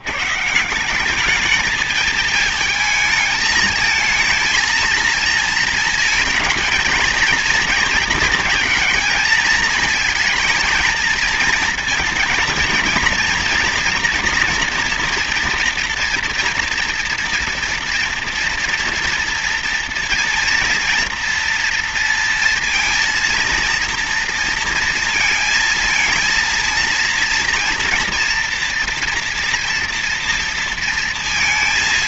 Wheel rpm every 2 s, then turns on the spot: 160, 220, 220, 230, 230, 220, 230, 230, 230, 230, 240, 230, 230, 230, 230, 230.
none